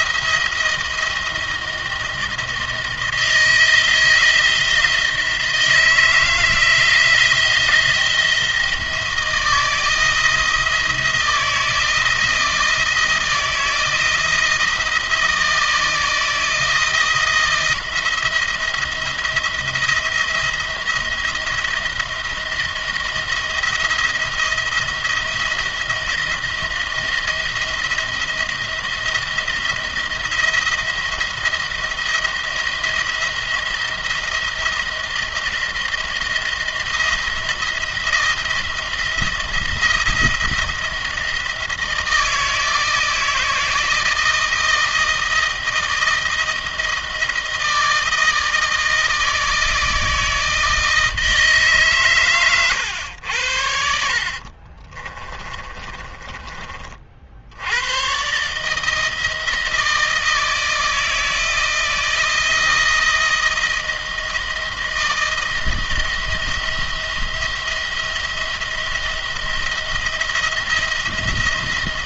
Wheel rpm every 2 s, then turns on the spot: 170, 170, 170, 170, 160, 170, 160, 160, 160, 170, 170, 170, 170, 170, 170, 170, 170, 170, 170, 160, 170, 160, 160, 170, 160, 160, 120, 40, 30, 150, 160, 170, 160, 160, 170, 170.
54-56